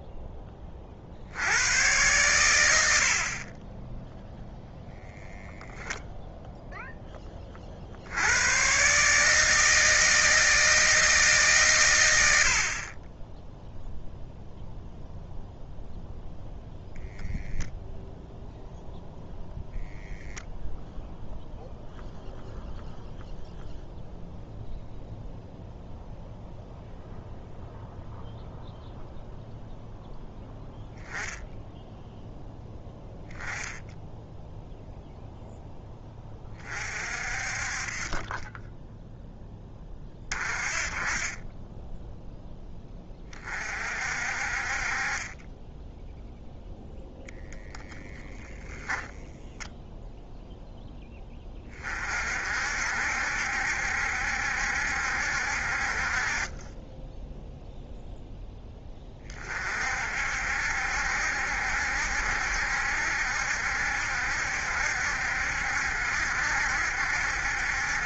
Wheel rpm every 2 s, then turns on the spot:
20, 90, 0, 0, 110, 160, 50, 0, 0, 0, 0, 0, 0, 0, 0, 0, 0, 0, 30, 10, 30, 10, 40, 0, 0, 0, 60, 70, 20, 10, 60, 70, 70, 70.
none